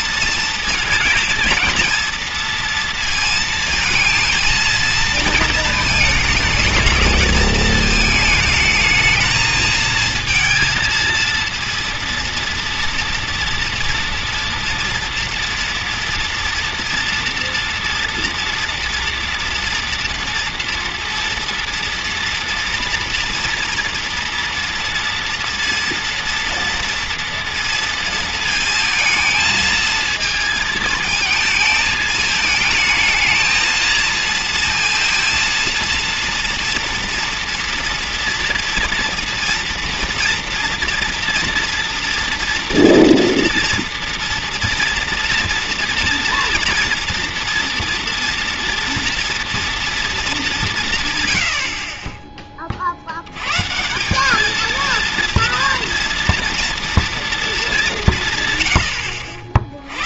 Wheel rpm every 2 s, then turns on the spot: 230, 230, 220, 230, 220, 230, 240, 230, 240, 230, 230, 240, 230, 230, 220, 220, 220, 230, 230, 240, 230, 230, 240, 230, 240, 200, 30, 220, 240, 120.
none